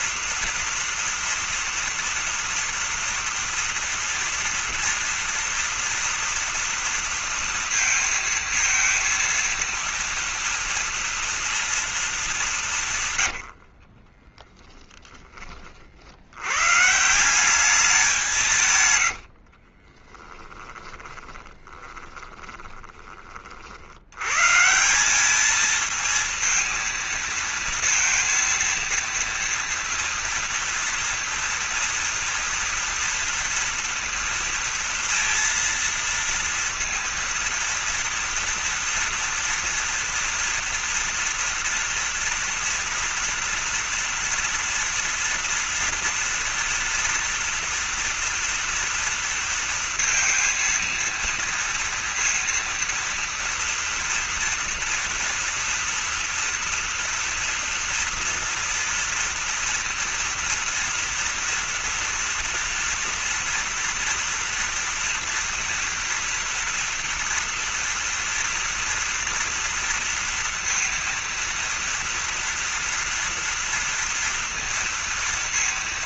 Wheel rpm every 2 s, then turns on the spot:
230, 230, 230, 240, 230, 230, 190, 20, 120, 150, 20, 20, 140, 230, 230, 230, 230, 230, 230, 230, 230, 230, 240, 230, 230, 230, 230, 240, 230, 230, 230, 230, 240, 230, 230, 230, 230, 230.
14-16 20-24